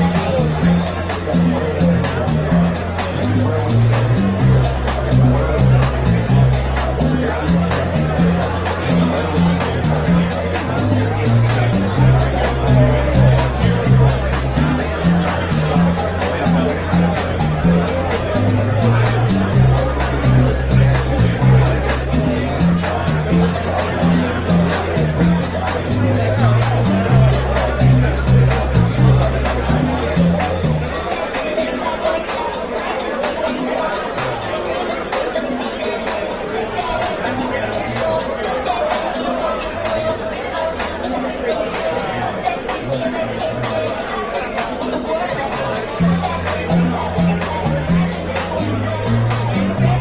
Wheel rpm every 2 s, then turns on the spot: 0, 0, 0, 0, 0, 0, 0, 0, 0, 0, 0, 0, 0, 0, 0, 0, 0, 0, 0, 0, 0, 0, 0, 0, 0.
none